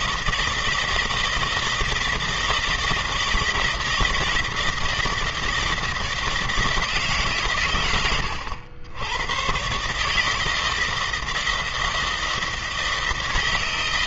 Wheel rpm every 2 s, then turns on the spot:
160, 160, 160, 160, 100, 160, 160.
none